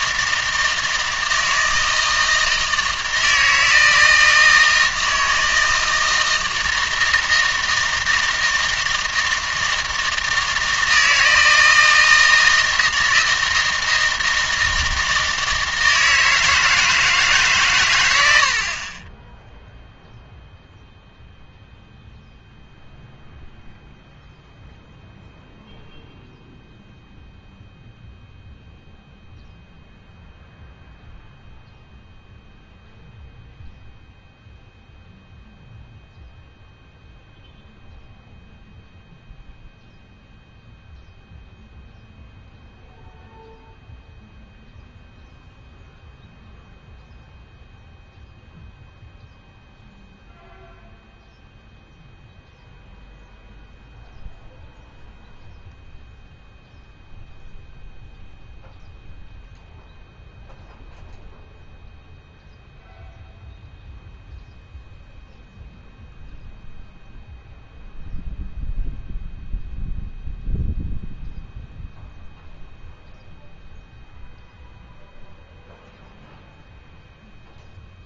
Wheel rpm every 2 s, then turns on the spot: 160, 160, 160, 160, 160, 160, 160, 160, 160, 60, 0, 0, 0, 0, 0, 0, 0, 0, 0, 0, 0, 0, 0, 0, 0, 0, 0, 0, 0, 0, 0, 0, 0, 0, 0, 0, 0, 0, 0.
none